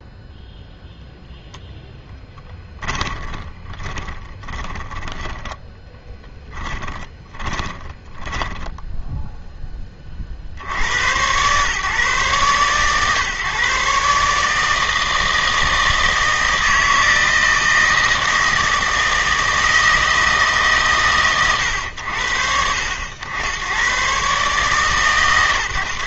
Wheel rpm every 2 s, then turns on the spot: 0, 20, 20, 10, 10, 80, 130, 160, 160, 160, 150, 80, 140.
2-10